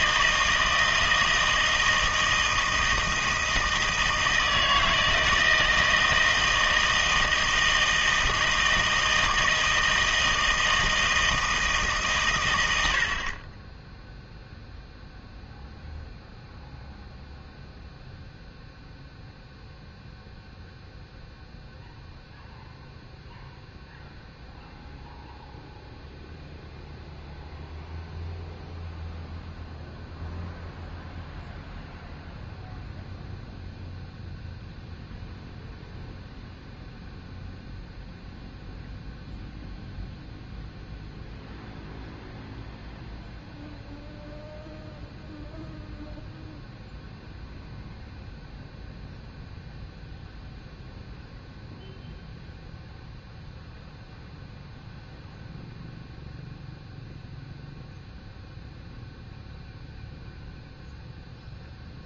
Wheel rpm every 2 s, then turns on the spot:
160, 160, 160, 160, 160, 160, 90, 0, 0, 0, 0, 0, 0, 0, 0, 0, 0, 0, 0, 0, 0, 0, 0, 0, 0, 0, 0, 0, 0, 0, 0.
none